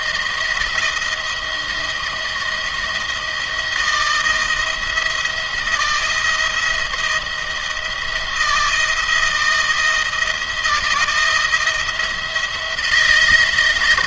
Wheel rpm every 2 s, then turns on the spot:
170, 160, 170, 160, 170, 170, 170.
none